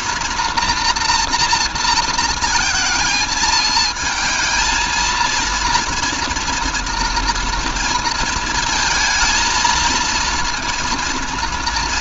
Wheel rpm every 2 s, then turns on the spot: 230, 220, 220, 230, 220, 230.
none